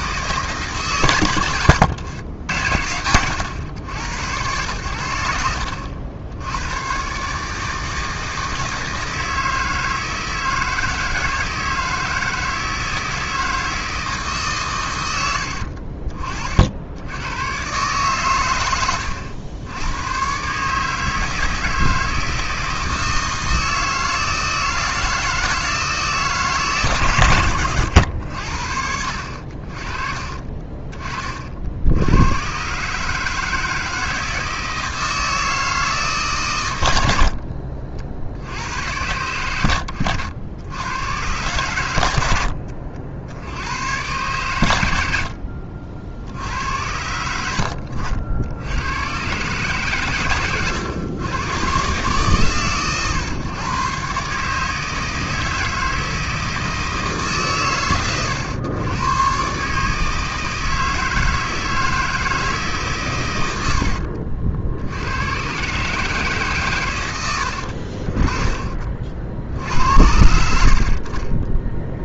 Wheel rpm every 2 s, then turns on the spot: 130, 90, 100, 120, 160, 160, 160, 110, 80, 90, 150, 160, 160, 130, 60, 40, 140, 160, 90, 100, 110, 70, 90, 80, 110, 110, 130, 160, 160, 110, 160, 130, 80, 110, 50, 50.
none